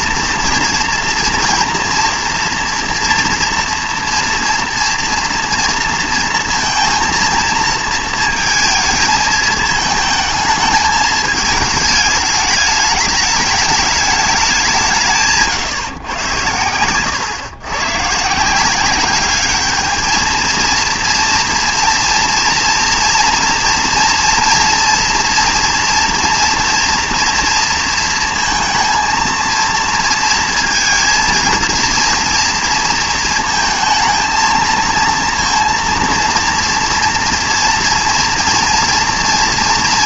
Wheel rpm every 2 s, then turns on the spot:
230, 240, 230, 230, 230, 220, 210, 190, 100, 170, 220, 230, 230, 230, 230, 230, 230, 220, 230, 230.
none